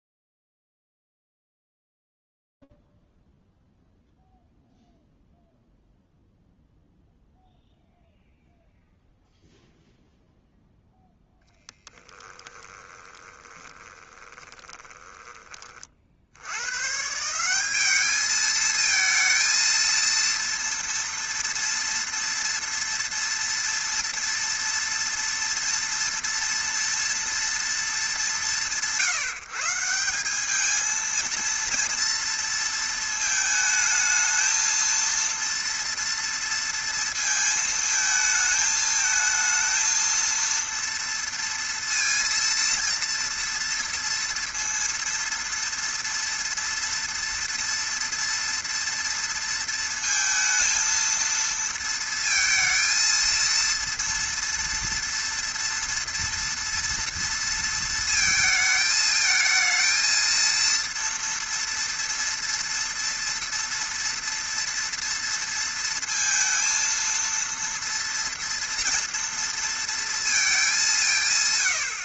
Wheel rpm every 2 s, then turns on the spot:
0, 0, 0, 0, 0, 0, 20, 20, 130, 220, 230, 230, 230, 230, 150, 220, 230, 230, 230, 220, 230, 230, 230, 230, 230, 230, 230, 230, 230, 220, 230, 230, 230, 230, 230, 210.
12-16